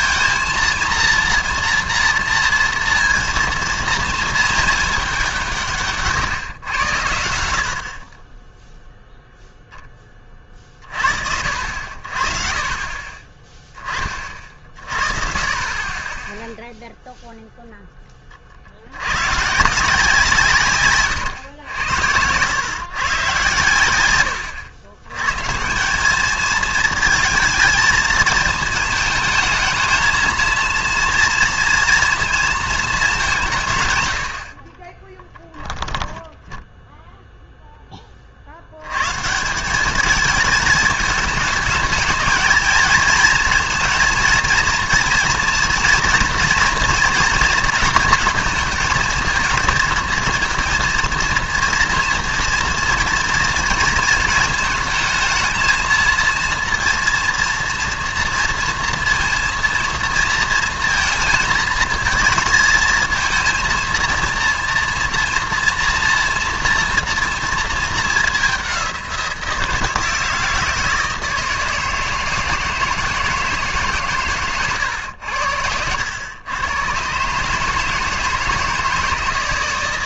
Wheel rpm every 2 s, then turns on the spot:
230, 230, 220, 120, 0, 30, 40, 40, 0, 70, 140, 120, 100, 220, 220, 230, 220, 40, 0, 90, 210, 220, 230, 240, 230, 230, 230, 220, 230, 230, 230, 220, 230, 230, 190, 160, 160, 110, 110, 160.
none